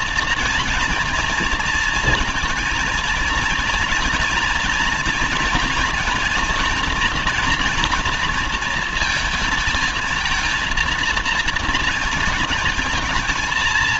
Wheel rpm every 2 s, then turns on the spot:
240, 230, 240, 230, 230, 230, 230.
none